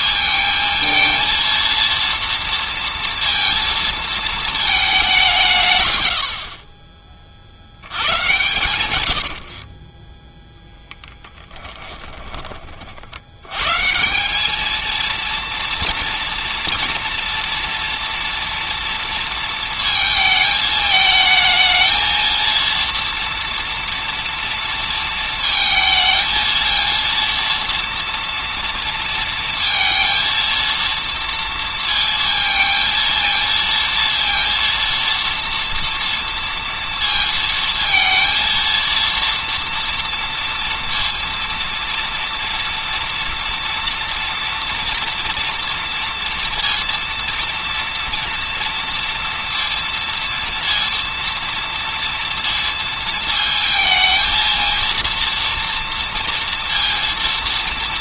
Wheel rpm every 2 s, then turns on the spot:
220, 230, 200, 20, 120, 20, 50, 220, 230, 230, 220, 230, 230, 220, 230, 230, 220, 230, 230, 230, 230, 230, 230, 230, 230, 230, 230, 230, 230.
8-12